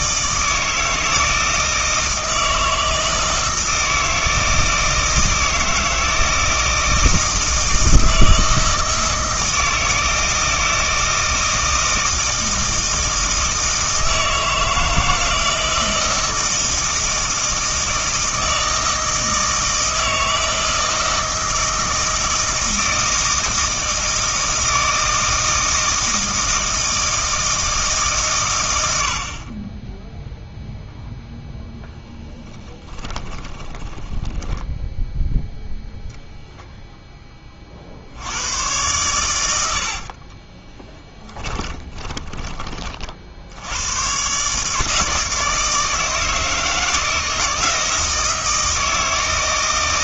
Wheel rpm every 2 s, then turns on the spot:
160, 160, 160, 160, 160, 160, 160, 160, 160, 160, 160, 160, 160, 160, 90, 0, 20, 10, 0, 100, 20, 30, 150, 160, 160.
32-36 40-42